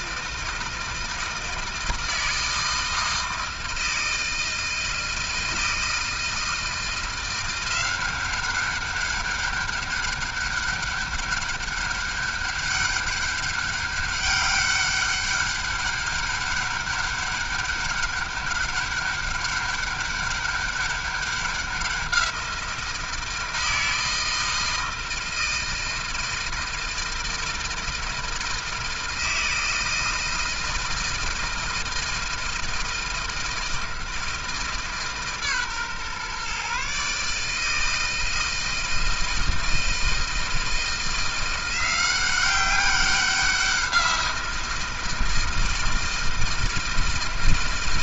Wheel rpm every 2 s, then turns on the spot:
160, 160, 160, 160, 190, 200, 200, 200, 200, 200, 200, 170, 160, 160, 160, 160, 160, 160, 140, 160, 160, 190, 170, 160.
none